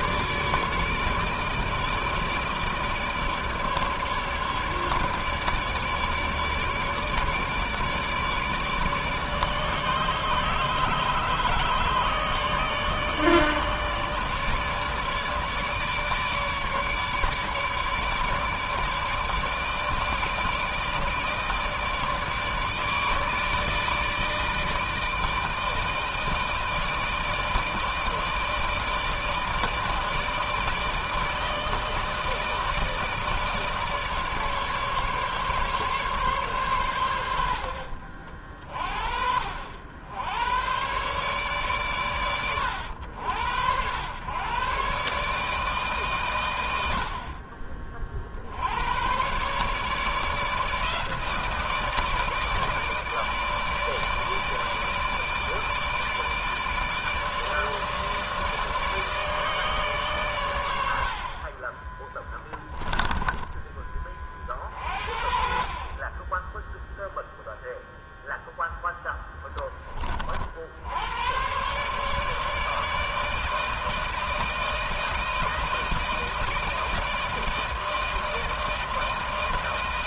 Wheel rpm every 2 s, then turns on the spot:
150, 150, 150, 150, 150, 150, 150, 150, 150, 150, 160, 160, 160, 160, 160, 160, 160, 150, 130, 50, 100, 110, 110, 120, 60, 150, 160, 150, 160, 150, 120, 20, 30, 10, 0, 50, 150, 160, 160, 160.
62-64